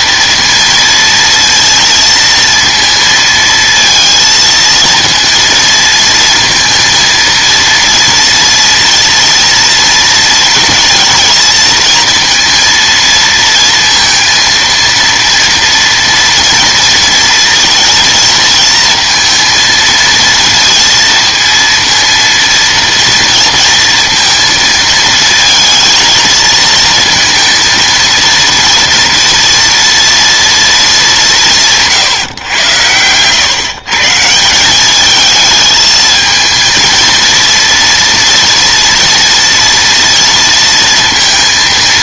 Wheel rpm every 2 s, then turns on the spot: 230, 230, 230, 230, 230, 230, 230, 230, 230, 230, 230, 230, 220, 230, 230, 230, 110, 190, 230, 230, 230.
none